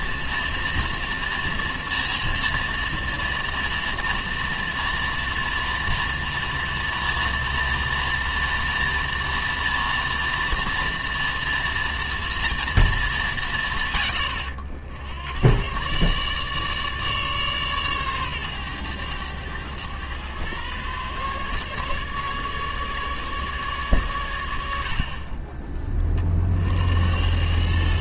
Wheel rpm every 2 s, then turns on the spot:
230, 230, 230, 230, 230, 230, 210, 80, 150, 110, 140, 150, 40, 90.
none